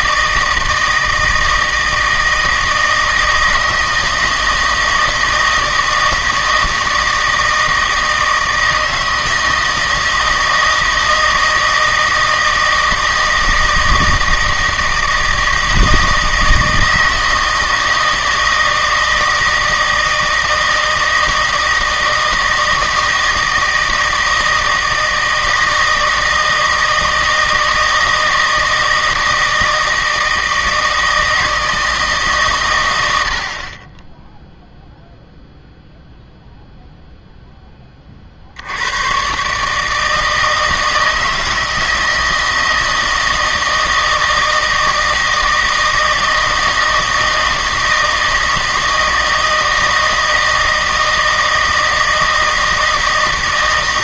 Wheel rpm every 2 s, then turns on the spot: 160, 160, 160, 160, 160, 160, 160, 160, 160, 160, 160, 160, 160, 160, 160, 160, 120, 0, 0, 80, 160, 160, 160, 160, 160, 160, 160.
none